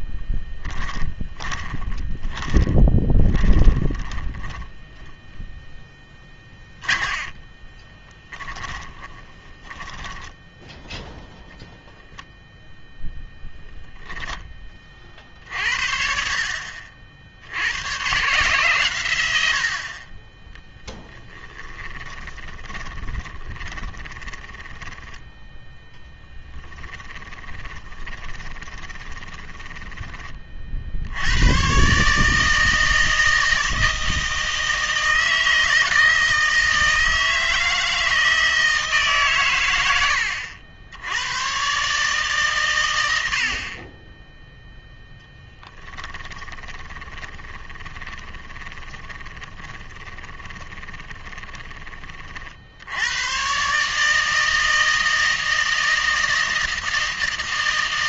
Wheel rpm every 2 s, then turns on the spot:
10, 10, 10, 20, 20, 0, 0, 30, 60, 120, 10, 20, 20, 10, 20, 60, 160, 160, 160, 160, 80, 110, 0, 20, 10, 20, 70, 160, 160.
0-10 22-30 46-52